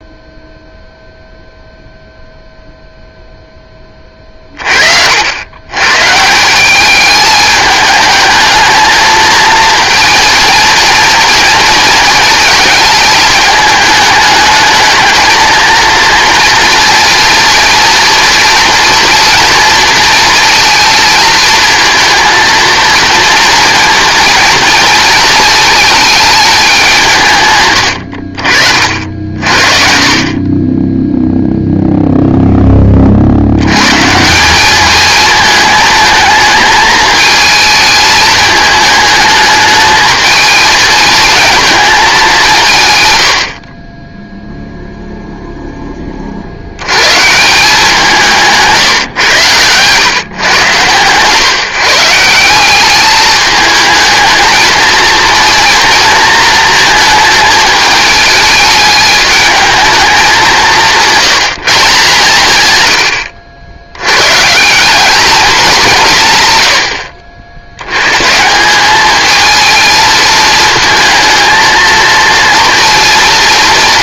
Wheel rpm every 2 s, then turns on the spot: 0, 0, 40, 180, 220, 230, 220, 220, 230, 230, 230, 230, 230, 200, 50, 20, 10, 200, 220, 220, 220, 180, 0, 70, 160, 130, 180, 220, 230, 210, 180, 120, 160, 120, 170, 220, 230.
48-50